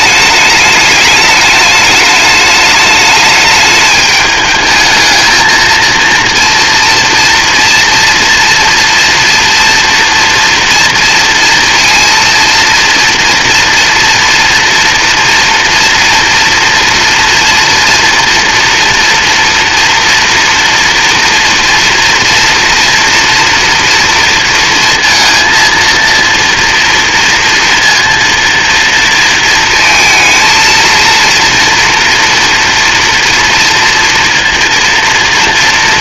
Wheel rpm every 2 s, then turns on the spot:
210, 210, 220, 230, 230, 240, 230, 230, 240, 230, 230, 230, 230, 230, 220, 230, 230, 230.
none